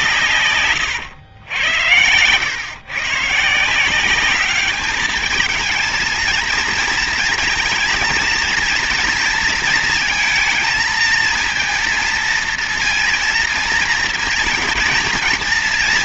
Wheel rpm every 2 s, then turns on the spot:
120, 110, 210, 230, 230, 230, 230, 230.
none